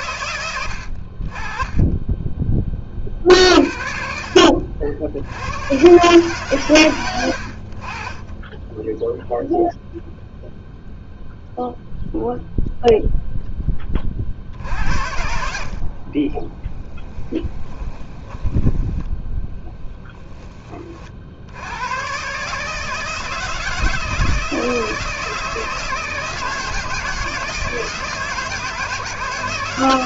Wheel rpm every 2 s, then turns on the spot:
30, 50, 90, 90, 0, 0, 0, 70, 10, 10, 50, 160, 160, 160, 160.
14-20